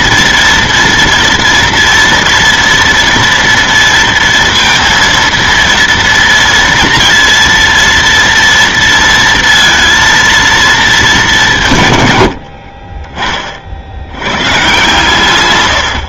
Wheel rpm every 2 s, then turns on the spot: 230, 230, 230, 230, 230, 220, 30, 130.
12-14